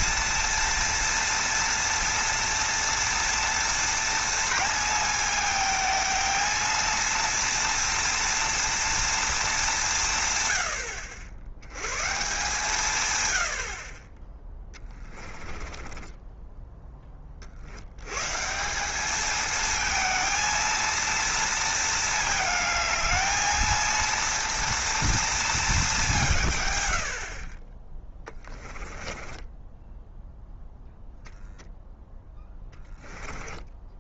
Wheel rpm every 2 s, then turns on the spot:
240, 230, 230, 230, 230, 90, 150, 10, 20, 190, 230, 220, 230, 100, 10, 0, 10.
14-16 28-30 32-34